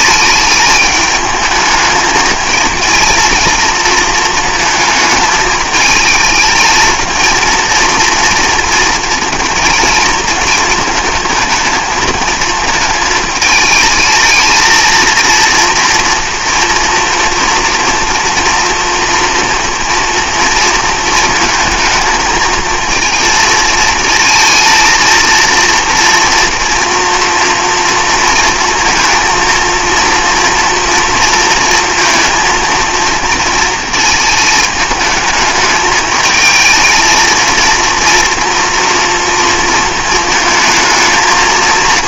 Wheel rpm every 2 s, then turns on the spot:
210, 220, 220, 220, 230, 230, 220, 230, 230, 230, 230, 220, 230, 230, 220, 230, 230, 210, 220, 230, 220.
none